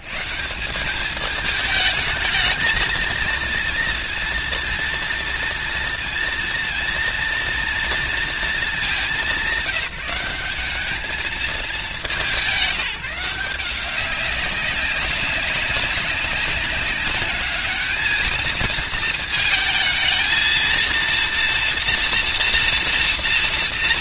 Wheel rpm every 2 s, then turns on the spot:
140, 220, 230, 230, 220, 200, 180, 190, 190, 220, 220, 240.
none